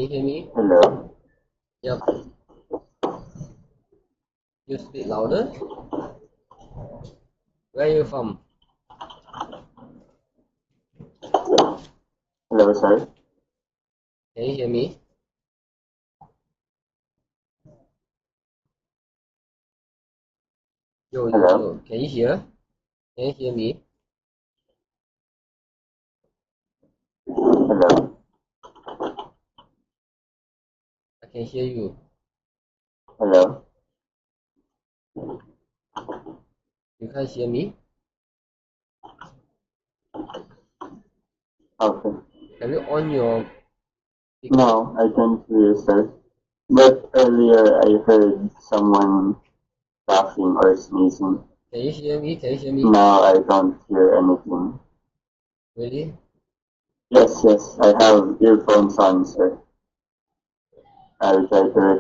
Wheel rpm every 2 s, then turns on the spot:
0, 0, 0, 0, 0, 0, 0, 0, 0, 0, 0, 0, 0, 0, 0, 0, 0, 0, 0, 0, 0, 0, 0, 0, 0, 0, 0, 0, 0, 0, 0.
none